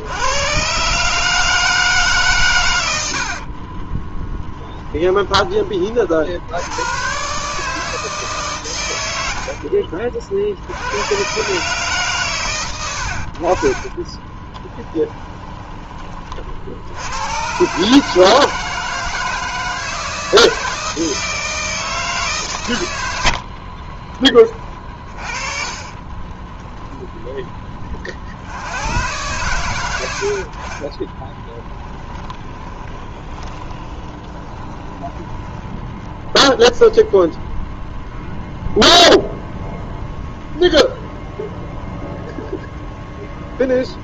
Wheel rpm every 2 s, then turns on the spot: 140, 90, 10, 110, 110, 100, 100, 10, 80, 160, 160, 90, 40, 10, 100, 20, 20, 20, 0, 0, 0, 0.
4-6 14-16 24-26 30-36